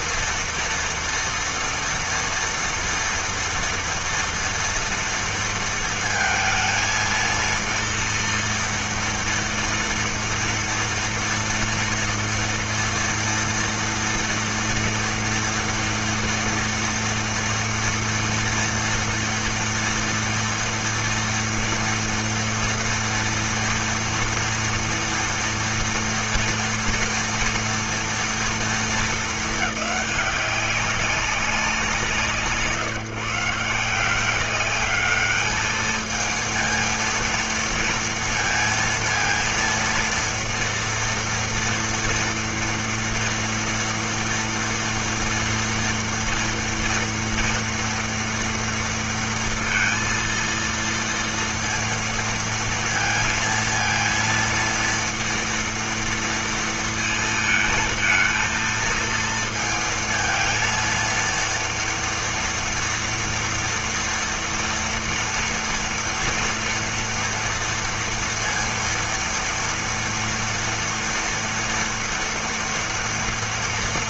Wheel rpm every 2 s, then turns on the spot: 230, 230, 230, 220, 230, 230, 240, 230, 230, 230, 230, 230, 230, 230, 230, 190, 150, 190, 230, 230, 230, 230, 240, 240, 240, 230, 230, 230, 230, 230, 230, 230, 230, 230, 230, 230, 230.
none